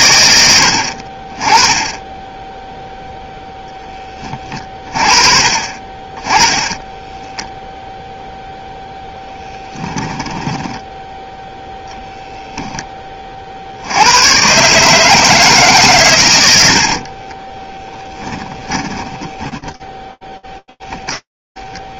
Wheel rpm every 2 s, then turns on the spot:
40, 0, 30, 10, 0, 10, 20, 160, 30, 20, 0.
6-8 10-12 16-20